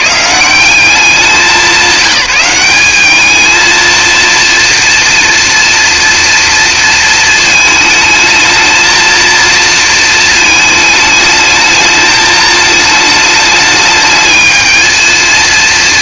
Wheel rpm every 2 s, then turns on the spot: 190, 200, 230, 230, 230, 220, 220, 220.
none